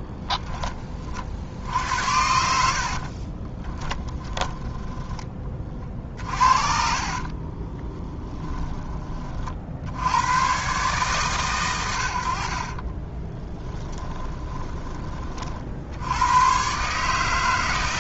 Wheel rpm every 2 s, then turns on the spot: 30, 70, 10, 50, 10, 120, 40, 20, 120.
2-8 12-16